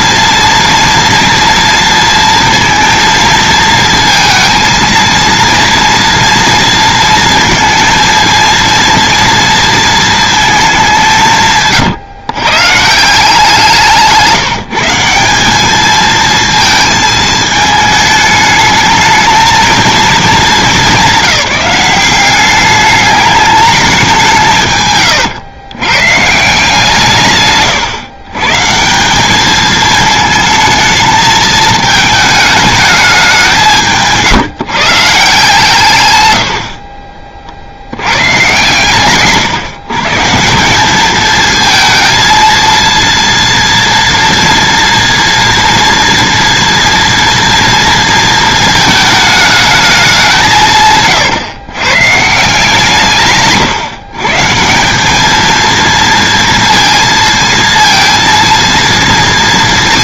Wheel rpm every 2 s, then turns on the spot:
230, 230, 230, 230, 230, 210, 140, 160, 220, 210, 200, 200, 150, 160, 150, 220, 220, 160, 50, 130, 190, 230, 240, 230, 220, 160, 160, 180, 230, 230.
36-38